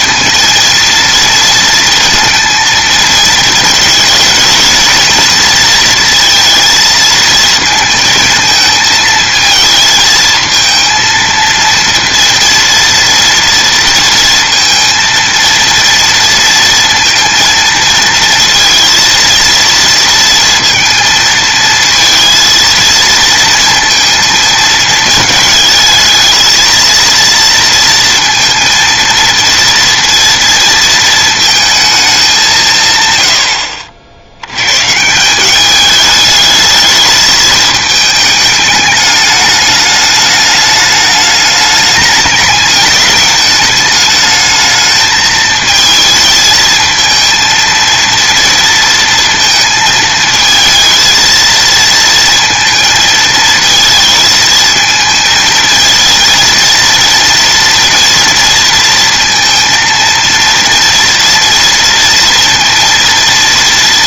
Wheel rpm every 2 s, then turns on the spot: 230, 220, 230, 230, 220, 230, 230, 230, 230, 230, 230, 230, 220, 230, 230, 230, 150, 140, 210, 210, 210, 210, 220, 220, 230, 220, 230, 220, 230, 230, 230, 230.
none